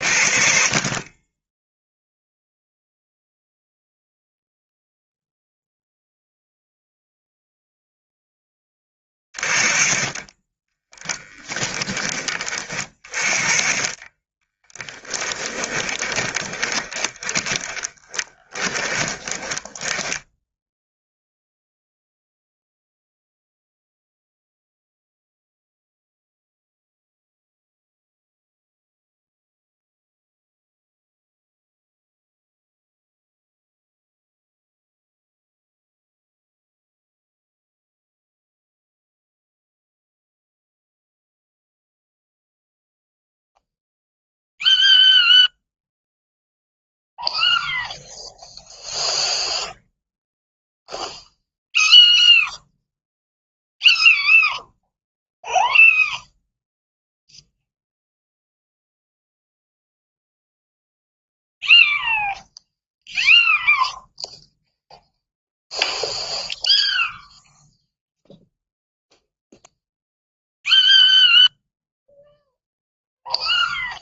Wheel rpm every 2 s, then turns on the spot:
40, 0, 0, 0, 20, 10, 30, 10, 20, 20, 0, 0, 0, 0, 0, 0, 0, 0, 0, 0, 0, 0, 0, 0, 0, 0, 0, 0, 0, 0, 0, 0, 0, 0, 0, 0, 0.
10-12 14-20